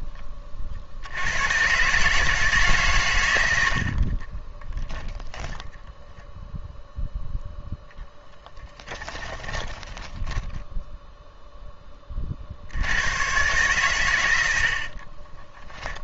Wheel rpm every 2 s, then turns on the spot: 70, 120, 10, 0, 10, 0, 90, 60.
8-10 14-16